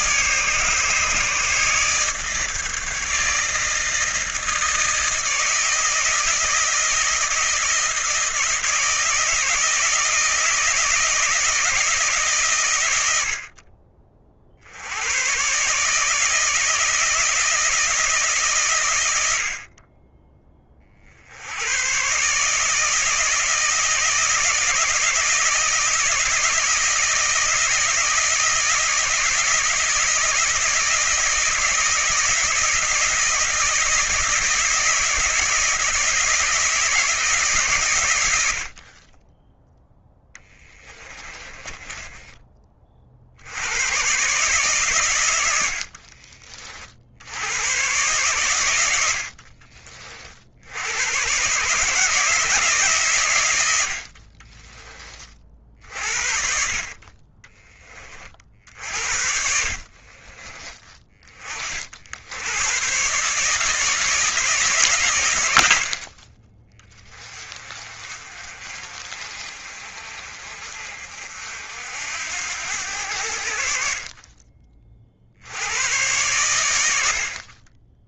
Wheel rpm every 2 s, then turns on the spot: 150, 150, 160, 160, 160, 170, 100, 80, 160, 120, 40, 160, 160, 160, 160, 160, 160, 160, 160, 40, 20, 40, 130, 60, 90, 80, 140, 20, 50, 60, 30, 130, 130, 20, 40, 50, 80, 40, 80.
40-42